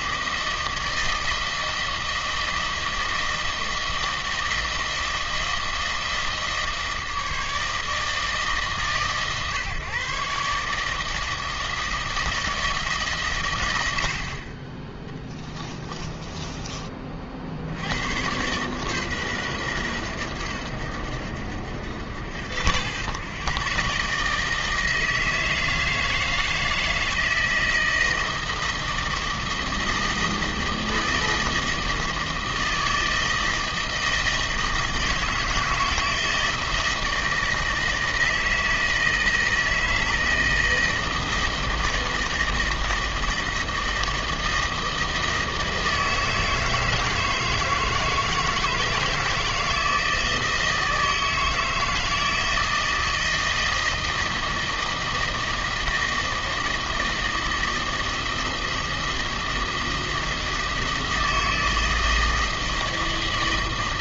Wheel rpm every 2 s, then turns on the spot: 160, 160, 160, 160, 150, 150, 160, 20, 20, 130, 90, 90, 160, 160, 160, 160, 160, 160, 160, 160, 160, 160, 160, 160, 160, 160, 160, 160, 160, 160, 160, 160.
none